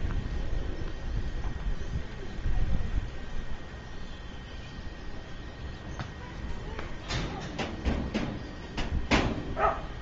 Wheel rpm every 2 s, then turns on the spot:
0, 0, 0, 0, 0.
none